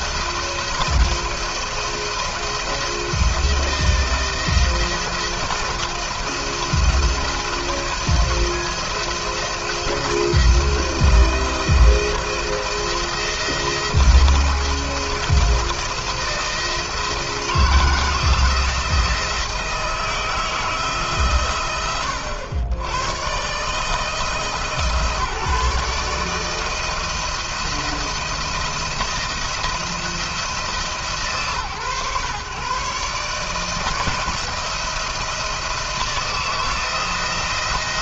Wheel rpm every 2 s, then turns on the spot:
170, 170, 170, 170, 170, 170, 170, 170, 170, 170, 160, 100, 160, 160, 170, 160, 130, 170, 170.
none